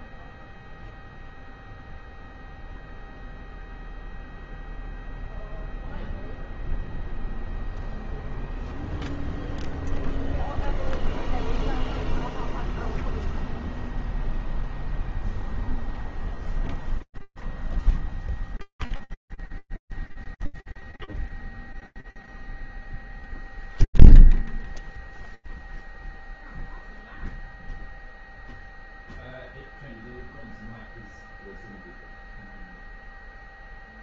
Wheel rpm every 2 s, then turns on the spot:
0, 0, 0, 0, 0, 0, 0, 0, 0, 0, 0, 0, 0, 0, 0, 0, 0.
none